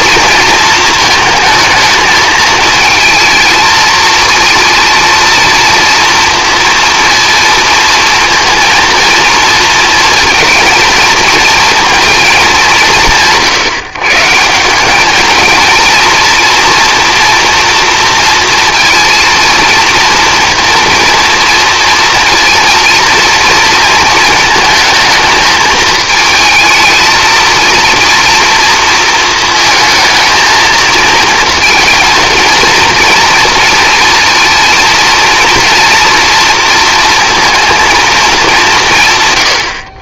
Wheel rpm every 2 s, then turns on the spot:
230, 220, 230, 230, 230, 230, 180, 190, 230, 230, 240, 230, 220, 220, 230, 230, 230, 230, 230, 150.
none